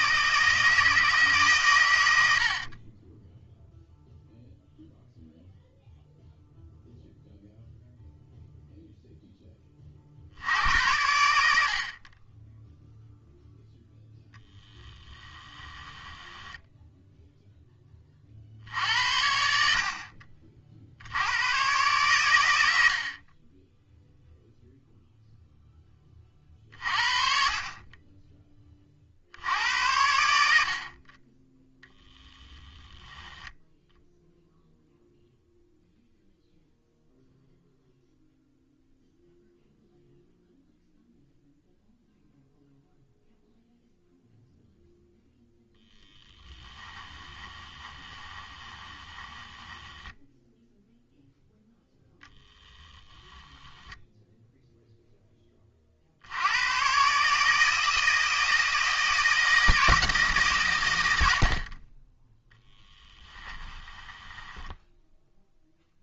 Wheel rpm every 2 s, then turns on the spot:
160, 40, 0, 0, 0, 80, 0, 10, 10, 80, 60, 70, 0, 40, 20, 50, 10, 0, 0, 0, 0, 0, 0, 10, 20, 0, 10, 0, 110, 160, 120, 10, 10.
14-18 46-50 52-54 62-66